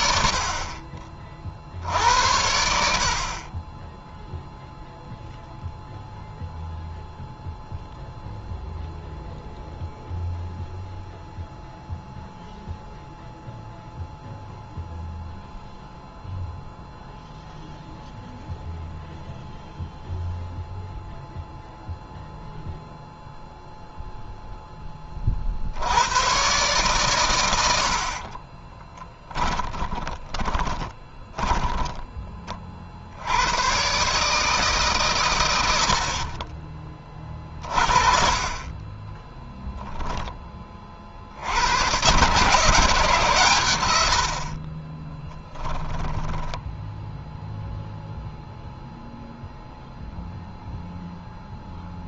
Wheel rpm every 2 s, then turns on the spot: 40, 80, 0, 0, 0, 0, 0, 0, 0, 0, 0, 0, 10, 120, 30, 20, 40, 140, 20, 20, 20, 130, 30, 10, 0, 0.
28-32 44-48